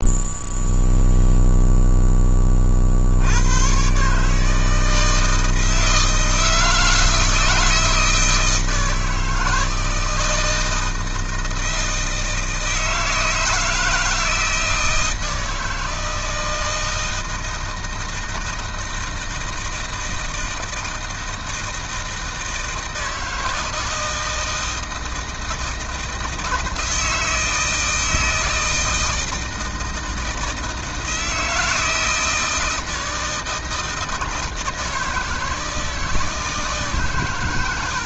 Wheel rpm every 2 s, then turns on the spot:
0, 50, 160, 160, 160, 160, 160, 160, 160, 160, 160, 160, 160, 160, 160, 160, 160, 160, 140.
none